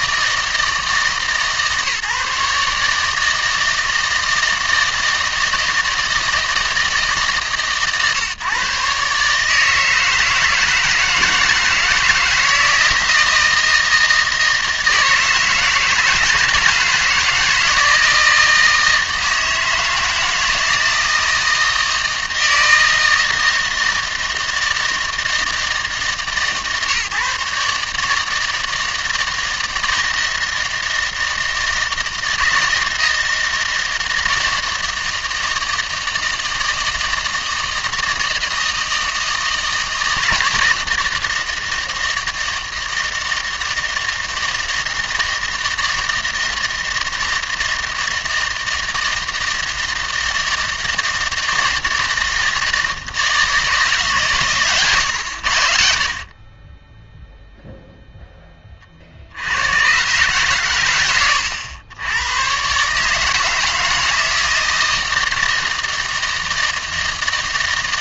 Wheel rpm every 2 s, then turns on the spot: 160, 150, 160, 160, 130, 160, 160, 160, 160, 160, 160, 160, 160, 140, 160, 160, 160, 160, 160, 160, 160, 160, 160, 160, 160, 160, 160, 130, 30, 30, 120, 130, 160, 160.
none